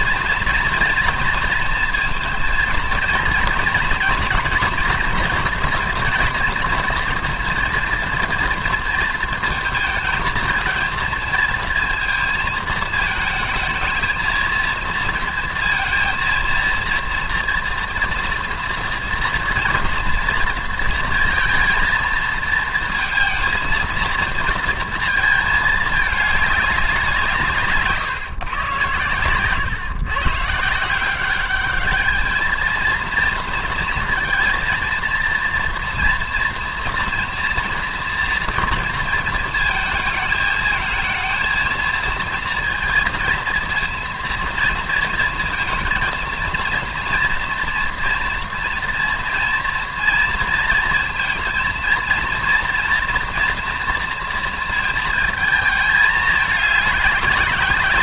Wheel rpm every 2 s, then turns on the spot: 230, 230, 240, 230, 230, 220, 220, 230, 230, 230, 230, 230, 230, 190, 120, 160, 230, 230, 230, 230, 220, 230, 230, 230, 240, 230, 230, 230, 200.
none